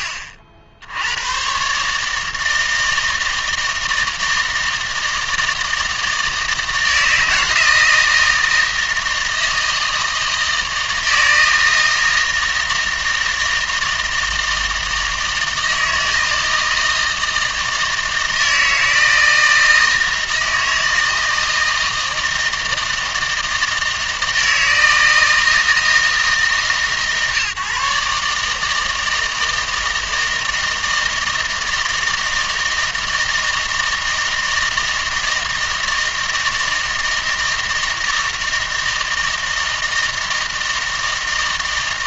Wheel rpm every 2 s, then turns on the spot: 60, 160, 160, 160, 160, 160, 160, 160, 160, 160, 160, 160, 160, 140, 150, 160, 160, 160, 160, 160, 160.
none